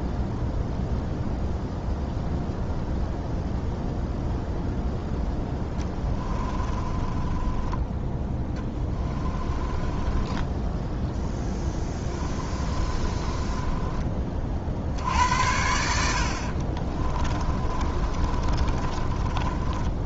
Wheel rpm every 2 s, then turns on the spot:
0, 0, 0, 20, 20, 10, 30, 70, 30, 30.
6-14 16-20